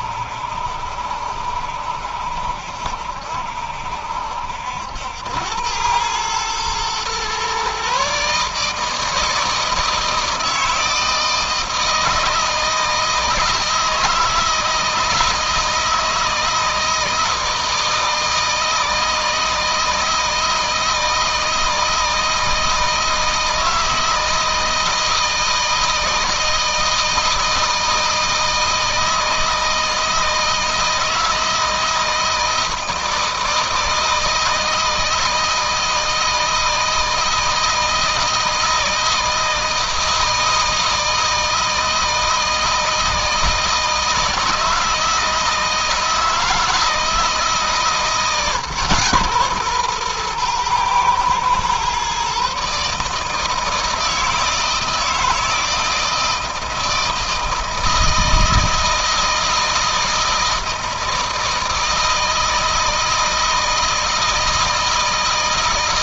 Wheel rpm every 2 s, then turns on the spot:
70, 70, 80, 120, 160, 160, 160, 160, 160, 160, 160, 160, 160, 160, 160, 160, 160, 160, 160, 160, 160, 160, 160, 160, 140, 120, 150, 160, 160, 160, 160, 160, 160.
none